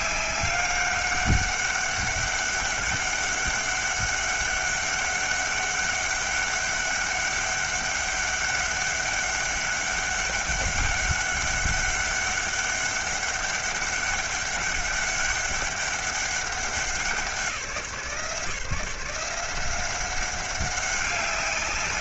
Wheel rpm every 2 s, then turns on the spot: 200, 200, 200, 200, 200, 200, 200, 200, 190, 170, 190.
none